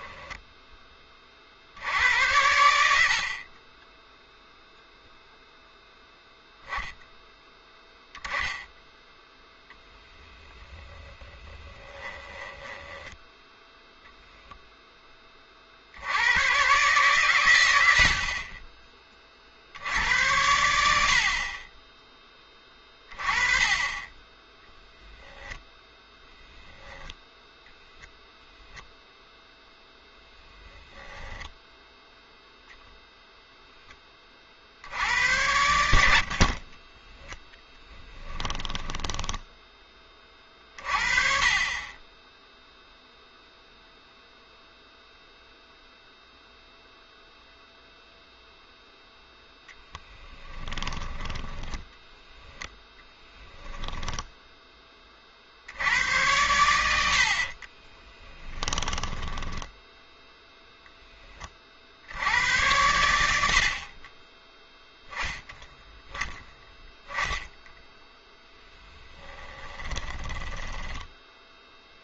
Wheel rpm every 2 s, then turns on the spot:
10, 80, 0, 0, 0, 10, 10, 0, 120, 20, 90, 20, 10, 0, 0, 20, 0, 50, 30, 10, 40, 0, 0, 0, 0, 10, 10, 10, 90, 10, 0, 100, 10, 0, 0, 10.
12-14 30-32 38-40 50-54 58-60